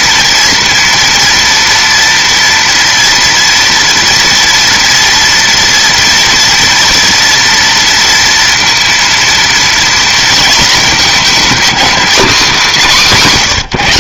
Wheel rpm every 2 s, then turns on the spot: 230, 230, 240, 240, 230, 220, 220.
none